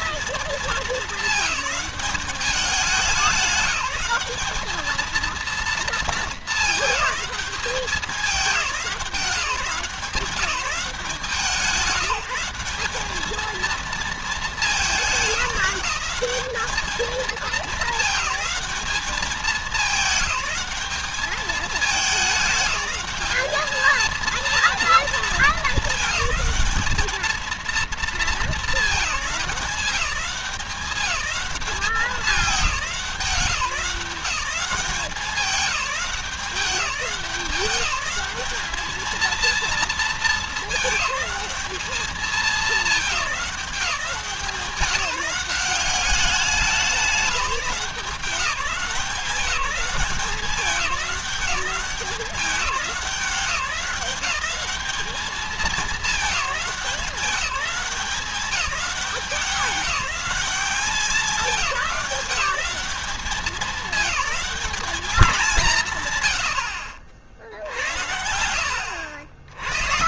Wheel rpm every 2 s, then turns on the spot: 210, 200, 220, 220, 180, 180, 200, 200, 210, 210, 210, 210, 230, 220, 210, 190, 200, 190, 190, 220, 210, 200, 180, 190, 190, 200, 190, 210, 200, 190, 200, 200, 210, 70, 80.
none